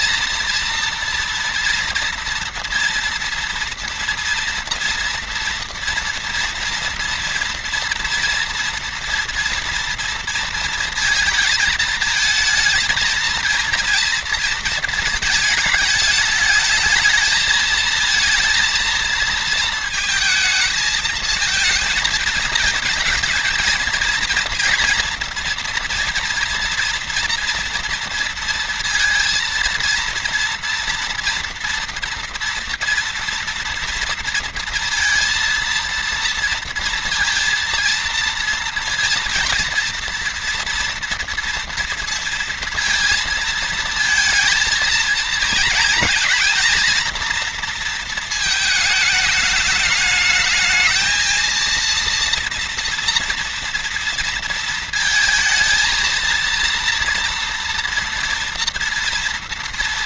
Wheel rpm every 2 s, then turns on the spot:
230, 230, 230, 230, 230, 230, 220, 230, 220, 230, 220, 230, 230, 230, 230, 230, 230, 230, 230, 230, 230, 230, 230, 230, 210, 220, 230, 230, 230, 230.
none